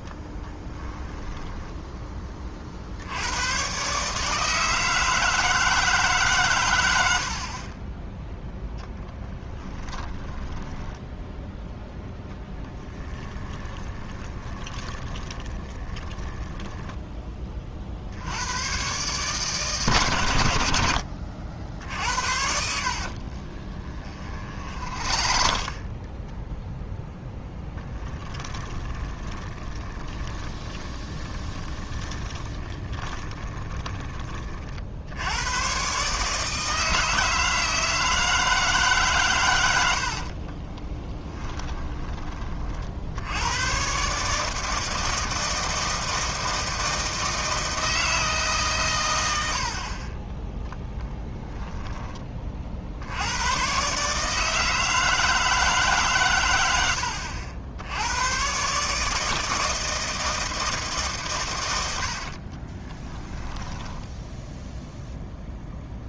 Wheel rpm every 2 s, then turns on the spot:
10, 50, 160, 110, 0, 10, 10, 20, 10, 120, 90, 60, 50, 0, 20, 20, 20, 50, 160, 150, 30, 40, 160, 160, 140, 10, 50, 160, 100, 140, 150, 20, 0.
0-2 10-12 14-16 22-26 28-34 40-42 62-64